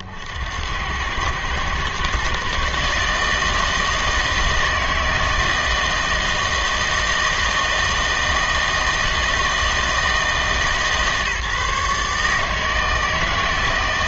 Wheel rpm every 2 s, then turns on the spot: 80, 140, 160, 160, 160, 150, 160.
none